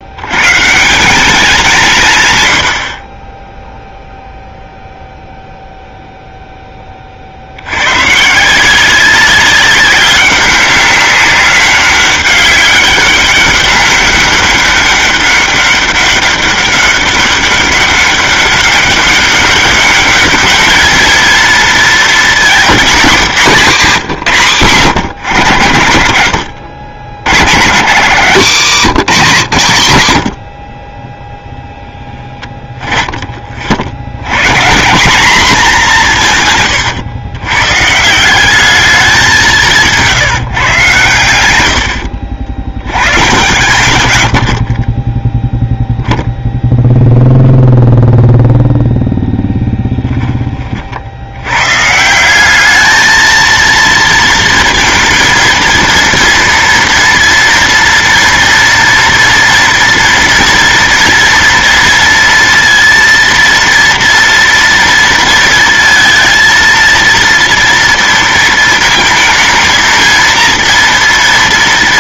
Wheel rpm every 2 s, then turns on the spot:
140, 80, 0, 10, 170, 200, 200, 200, 200, 200, 220, 240, 140, 80, 180, 70, 20, 160, 140, 200, 140, 90, 50, 0, 0, 40, 200, 230, 230, 230, 230, 230, 230, 230, 230, 230.
32-34